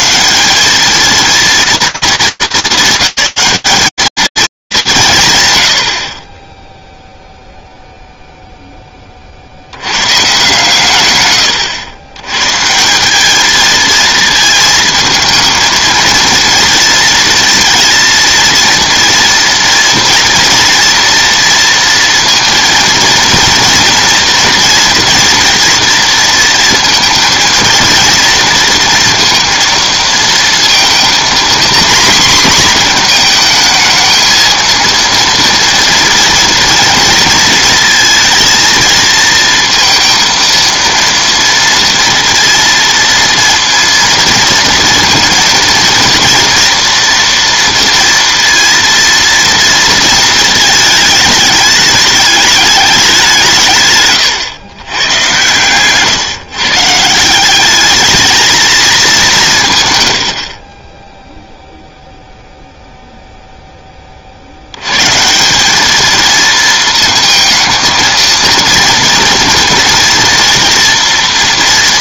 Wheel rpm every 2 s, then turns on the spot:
220, 200, 210, 10, 20, 130, 180, 220, 230, 230, 230, 230, 230, 230, 230, 230, 230, 230, 230, 230, 230, 230, 230, 230, 230, 220, 200, 120, 160, 210, 10, 0, 150, 220, 230, 240.
none